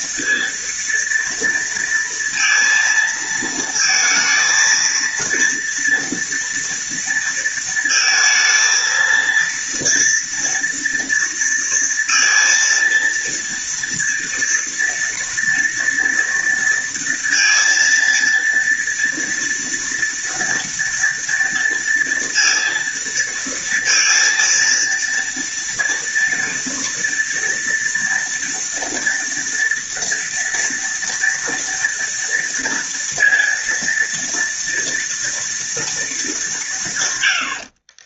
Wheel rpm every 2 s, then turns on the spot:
230, 230, 230, 230, 230, 230, 230, 230, 230, 230, 230, 230, 230, 230, 230, 230, 230, 230, 120.
none